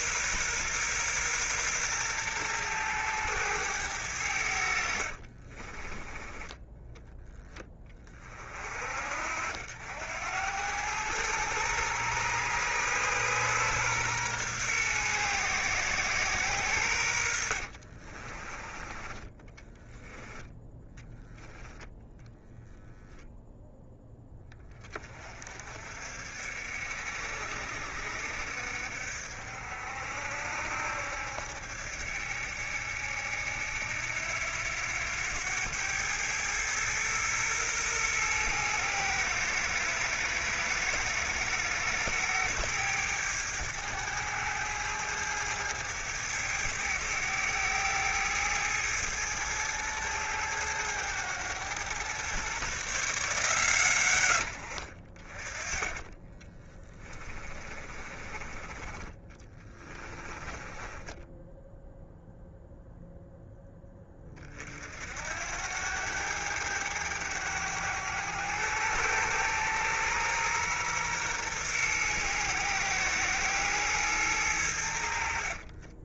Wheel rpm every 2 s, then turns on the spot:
120, 110, 80, 10, 50, 100, 120, 120, 100, 20, 0, 0, 30, 60, 60, 70, 70, 90, 110, 110, 110, 110, 110, 100, 110, 110, 140, 50, 20, 20, 10, 0, 50, 100, 110, 120, 120, 80.
4-6 56-62